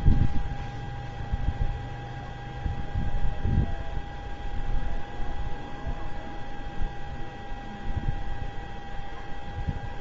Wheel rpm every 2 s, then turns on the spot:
0, 0, 0, 0, 0.
none